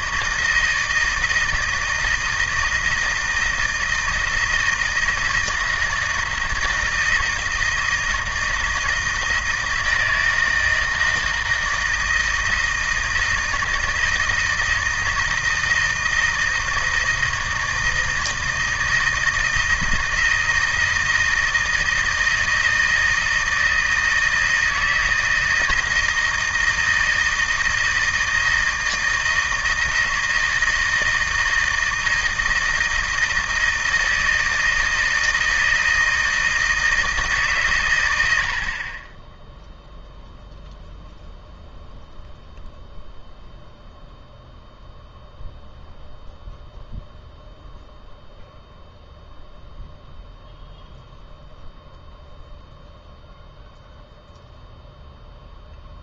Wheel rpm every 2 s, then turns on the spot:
160, 160, 160, 160, 160, 160, 160, 160, 160, 160, 170, 160, 160, 160, 160, 160, 160, 160, 160, 70, 0, 0, 0, 0, 0, 0, 0, 0.
none